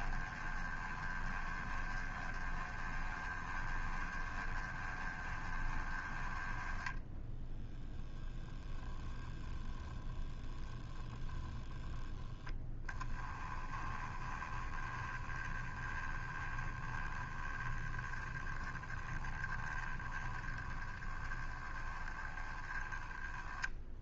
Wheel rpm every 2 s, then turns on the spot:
20, 20, 20, 10, 10, 10, 20, 10, 10, 20, 10, 10.
6-8 10-12